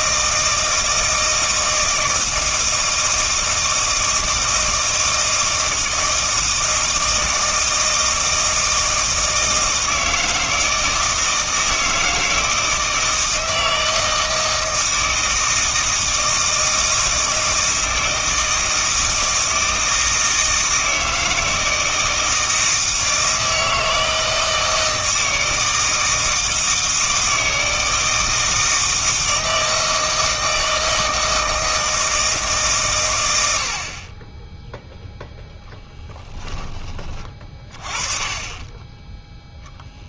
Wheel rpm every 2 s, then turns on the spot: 160, 160, 160, 160, 160, 160, 160, 160, 160, 160, 160, 160, 160, 160, 160, 160, 140, 10, 20, 20.
38-40